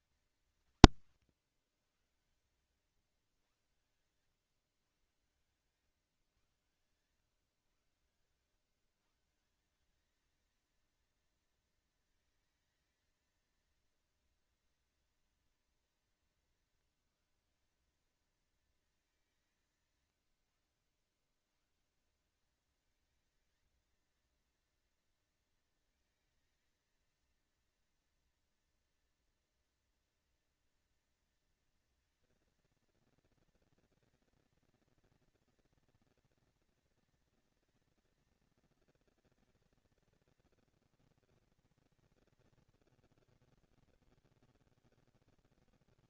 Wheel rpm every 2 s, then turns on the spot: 180, 120, 110, 130, 120, 210, 220, 220, 200, 210, 80, 180, 230, 220, 230, 230, 230, 230, 230, 230, 230, 210, 160.
none